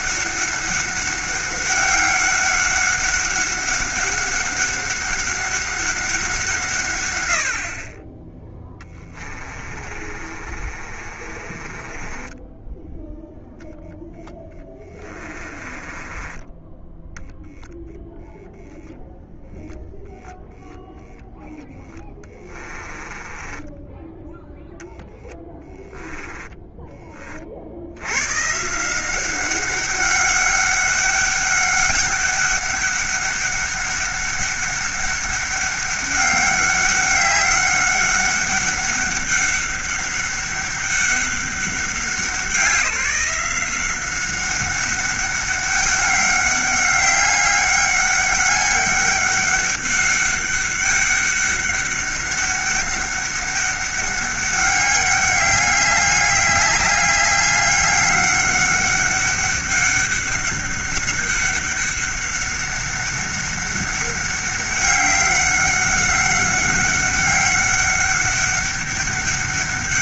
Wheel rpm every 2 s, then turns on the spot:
200, 200, 200, 140, 10, 40, 10, 10, 10, 10, 0, 20, 0, 10, 160, 200, 200, 200, 200, 200, 200, 180, 200, 190, 200, 200, 200, 200, 200, 200, 200, 200, 200, 200, 200.
8-18 22-24 26-28